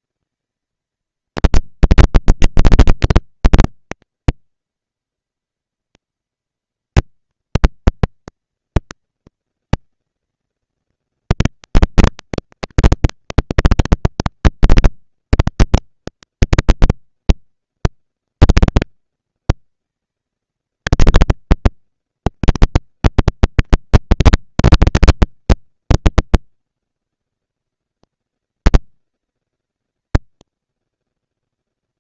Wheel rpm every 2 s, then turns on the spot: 230, 230, 230, 230, 220, 230, 230, 230, 230, 230, 230, 230, 230, 220, 190, 210.
none